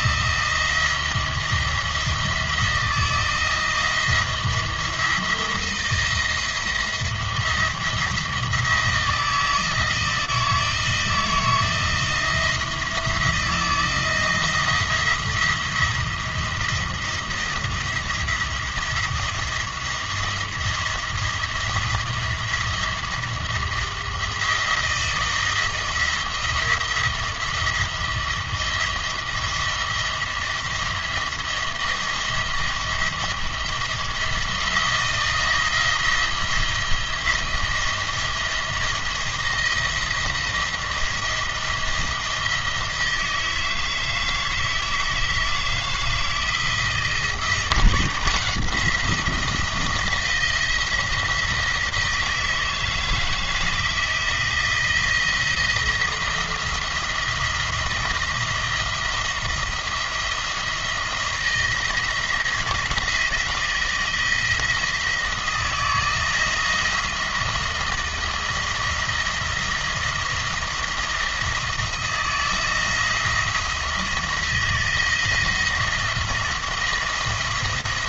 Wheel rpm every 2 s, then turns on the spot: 170, 170, 170, 170, 160, 160, 160, 170, 170, 170, 170, 170, 160, 170, 170, 170, 170, 170, 170, 160, 170, 160, 160, 160, 170, 170, 160, 170, 170, 170, 170, 170, 170, 170, 170, 170, 170, 170, 160.
none